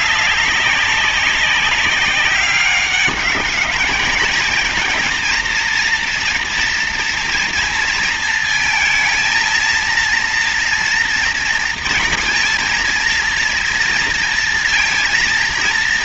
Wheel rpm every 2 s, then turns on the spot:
200, 200, 230, 230, 220, 230, 230, 230.
none